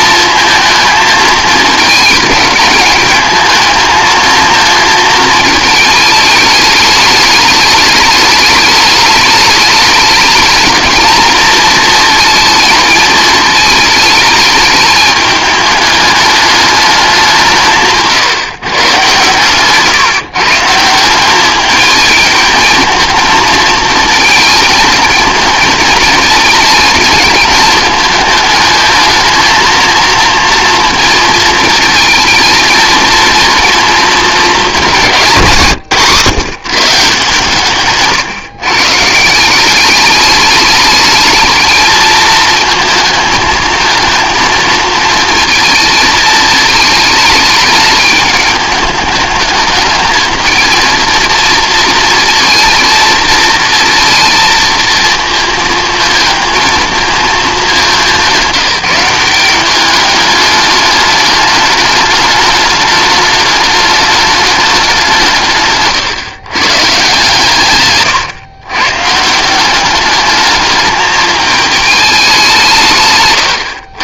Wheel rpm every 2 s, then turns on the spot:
220, 210, 230, 210, 210, 220, 220, 210, 210, 150, 150, 220, 220, 220, 220, 230, 220, 210, 150, 150, 210, 220, 230, 220, 210, 220, 230, 230, 220, 180, 210, 210, 200, 140, 130, 210, 170.
none